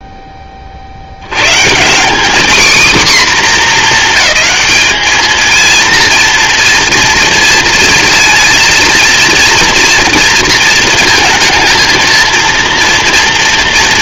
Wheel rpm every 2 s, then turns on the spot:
50, 250, 220, 230, 230, 220, 230.
none